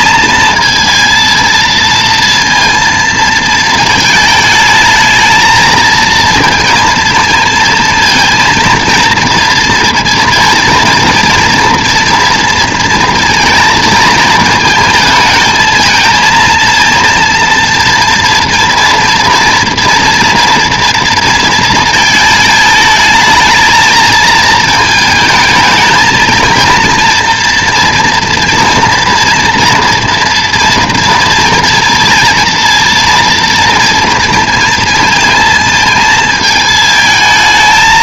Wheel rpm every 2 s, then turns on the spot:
230, 230, 220, 230, 230, 230, 230, 220, 230, 230, 230, 220, 220, 230, 230, 230, 230, 230, 220.
none